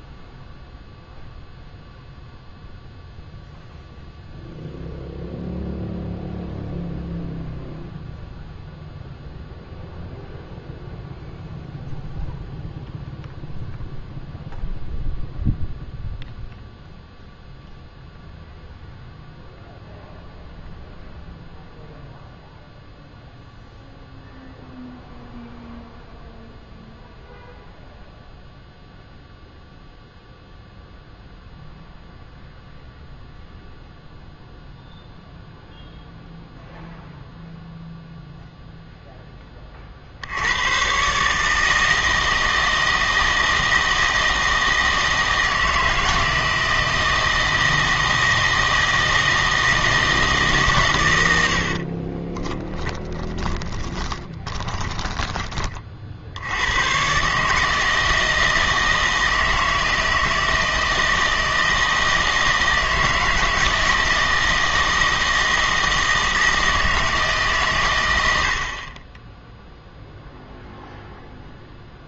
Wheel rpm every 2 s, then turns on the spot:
0, 0, 0, 0, 0, 0, 0, 0, 0, 0, 0, 0, 0, 0, 0, 0, 0, 0, 0, 0, 100, 160, 160, 160, 160, 140, 20, 40, 90, 160, 160, 160, 160, 160, 60, 0.
52-56